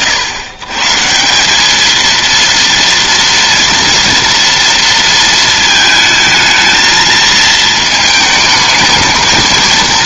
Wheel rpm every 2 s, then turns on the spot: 140, 230, 230, 220, 220.
none